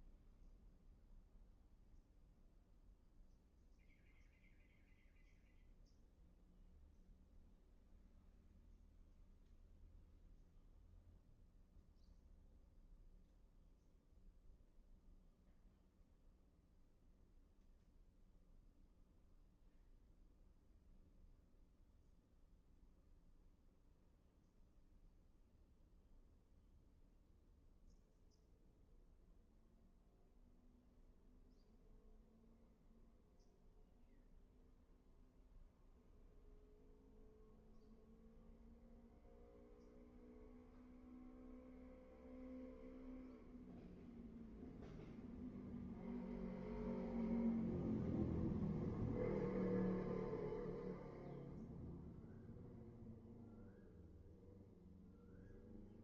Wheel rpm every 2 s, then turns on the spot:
0, 0, 0, 0, 0, 0, 0, 0, 0, 0, 0, 0, 0, 0, 0, 0, 0, 0, 0, 0, 0, 0, 0, 0, 0, 0, 0, 0.
none